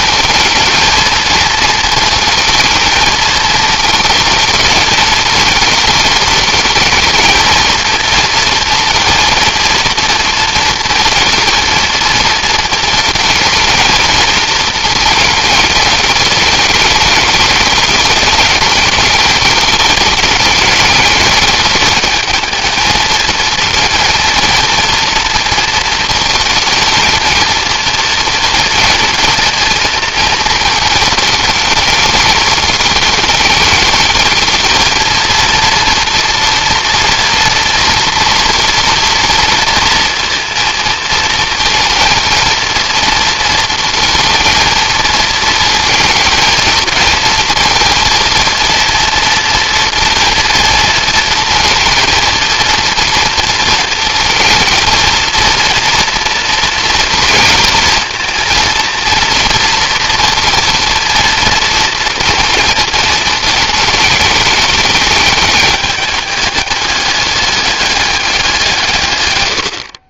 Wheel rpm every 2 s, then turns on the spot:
220, 230, 220, 220, 230, 220, 220, 220, 210, 220, 210, 220, 220, 230, 230, 220, 210, 220, 230, 230, 230, 230, 220, 220, 230, 230, 230, 220, 230, 230, 230, 230, 220, 200, 180.
none